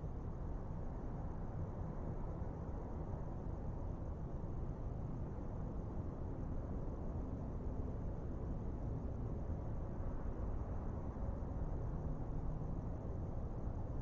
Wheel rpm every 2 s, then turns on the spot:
0, 0, 0, 0, 0, 0, 0.
none